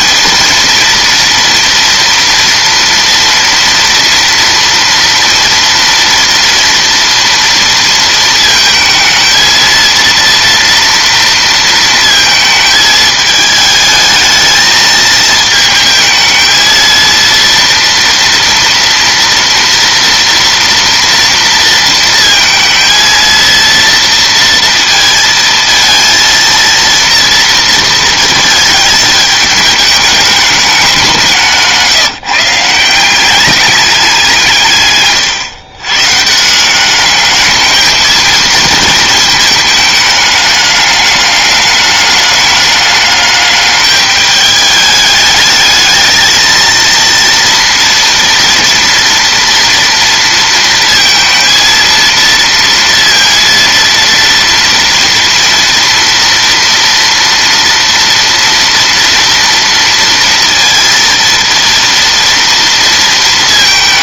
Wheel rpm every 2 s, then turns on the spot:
230, 230, 230, 230, 220, 230, 220, 220, 220, 230, 230, 230, 230, 230, 220, 210, 160, 150, 170, 230, 210, 210, 210, 230, 230, 230, 230, 230, 230, 230, 230, 230.
none